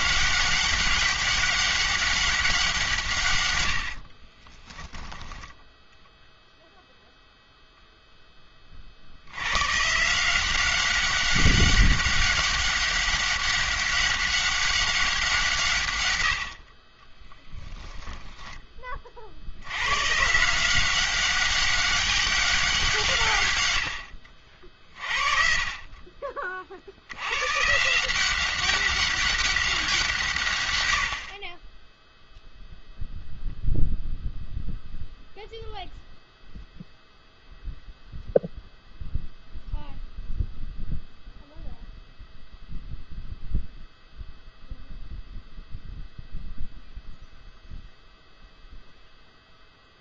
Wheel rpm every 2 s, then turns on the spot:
200, 180, 10, 0, 30, 190, 200, 200, 40, 20, 180, 190, 50, 50, 190, 120, 0, 0, 0, 0, 0, 0, 0, 0, 0.
4-6